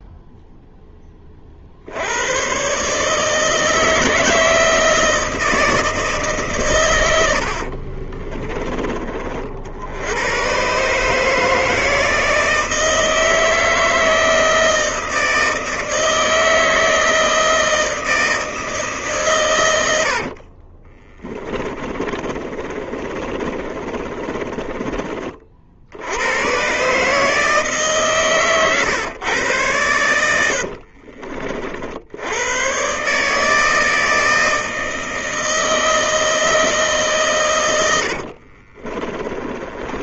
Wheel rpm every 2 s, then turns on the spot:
0, 140, 160, 120, 30, 130, 160, 160, 160, 160, 40, 30, 30, 110, 130, 70, 110, 160, 160, 50.
20-26 30-32 38-40